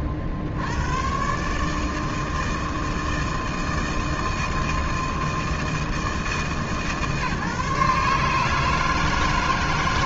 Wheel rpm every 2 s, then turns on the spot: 70, 160, 160, 150, 150.
none